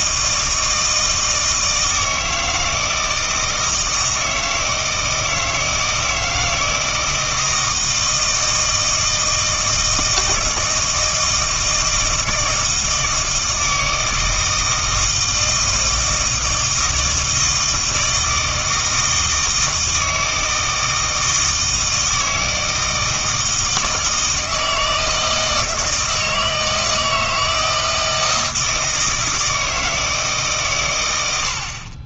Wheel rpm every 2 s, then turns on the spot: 160, 160, 160, 160, 160, 160, 160, 160, 160, 160, 160, 160, 160, 160, 160, 140.
none